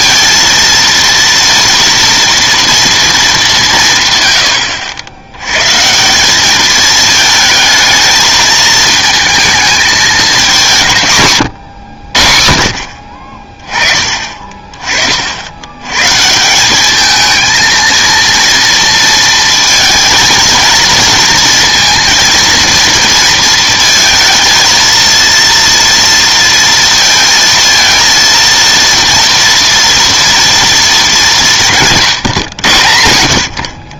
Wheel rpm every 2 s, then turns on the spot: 230, 230, 100, 210, 220, 180, 50, 30, 180, 230, 230, 230, 230, 230, 230, 230, 120.
none